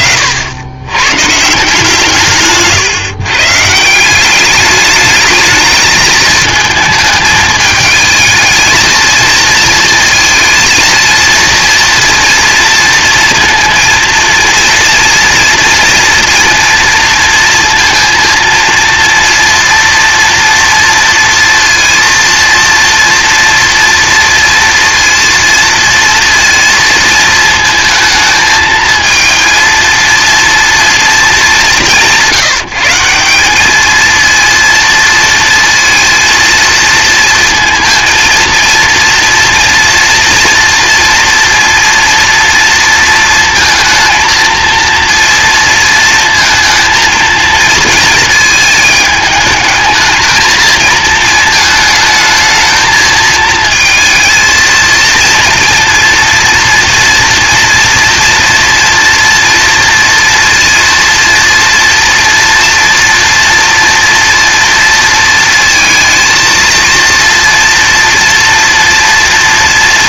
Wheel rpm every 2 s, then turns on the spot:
90, 140, 210, 220, 230, 230, 230, 230, 230, 230, 230, 230, 230, 230, 220, 230, 170, 230, 230, 230, 230, 230, 230, 230, 220, 220, 220, 220, 230, 230, 230, 230, 230, 230, 230.
none